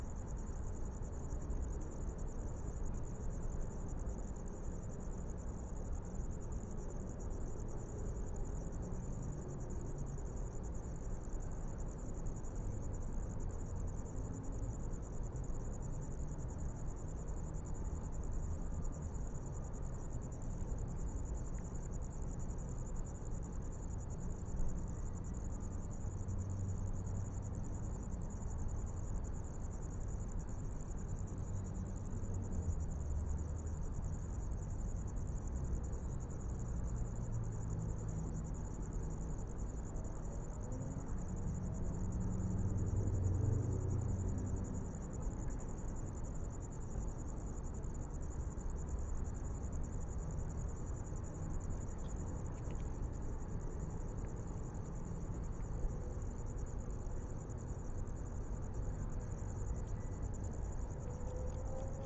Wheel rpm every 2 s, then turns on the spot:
0, 0, 0, 0, 0, 0, 0, 0, 0, 0, 0, 0, 0, 0, 0, 0, 0, 0, 0, 0, 0, 0, 0, 0, 0, 0, 0, 0, 0, 0, 0.
none